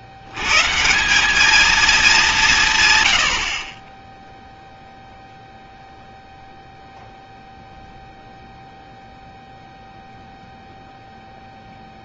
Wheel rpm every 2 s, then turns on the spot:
90, 160, 0, 0, 0, 0.
none